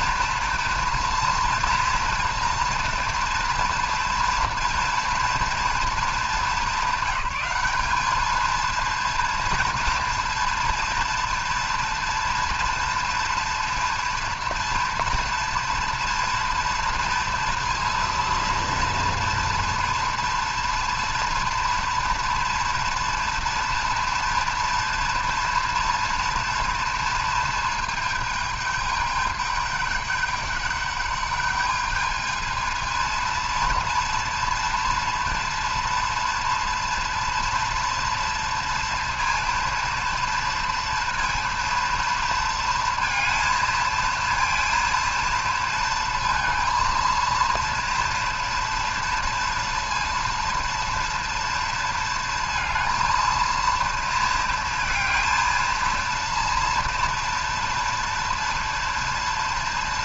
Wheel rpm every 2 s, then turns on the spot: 230, 230, 230, 200, 220, 230, 230, 230, 230, 230, 240, 230, 230, 230, 210, 200, 220, 230, 230, 230, 230, 230, 230, 230, 230, 230, 230, 230, 230, 230.
none